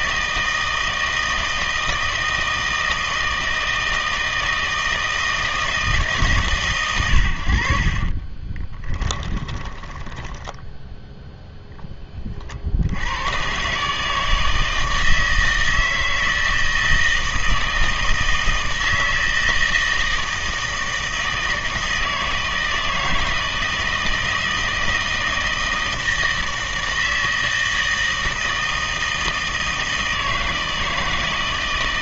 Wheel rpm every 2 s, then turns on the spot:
160, 160, 160, 120, 20, 10, 60, 160, 160, 160, 160, 160, 160, 160, 160, 160.
8-12